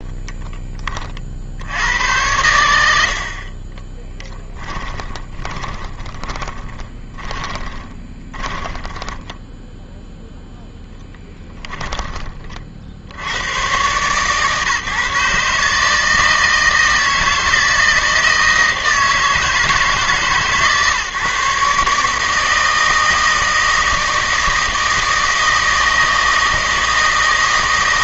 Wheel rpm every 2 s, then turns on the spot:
10, 90, 10, 20, 10, 0, 40, 140, 160, 160, 140, 160, 160, 160.
4-10